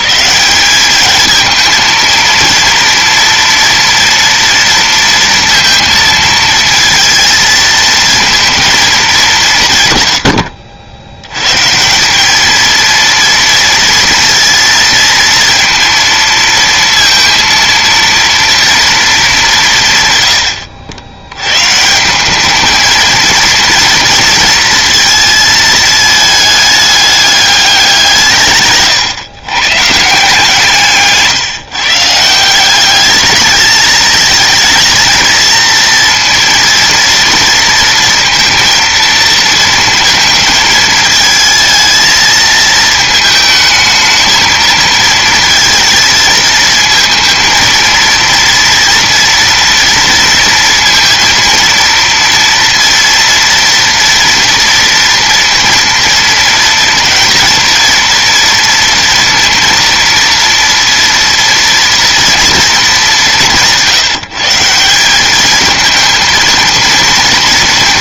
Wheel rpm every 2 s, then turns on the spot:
180, 230, 230, 230, 220, 80, 220, 230, 230, 230, 90, 210, 230, 210, 150, 160, 190, 220, 230, 230, 220, 220, 230, 220, 230, 230, 230, 230, 230, 230, 230, 230, 180, 230.
none